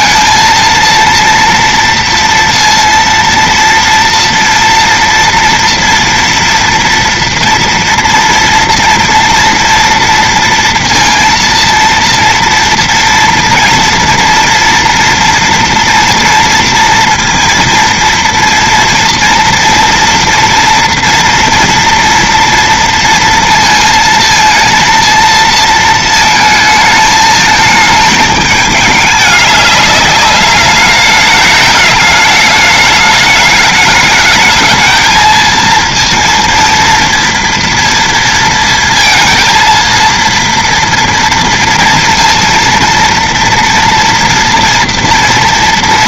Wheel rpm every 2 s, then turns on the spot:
230, 230, 230, 230, 230, 230, 230, 230, 230, 230, 230, 230, 230, 220, 210, 200, 210, 220, 230, 230, 230, 230, 230.
none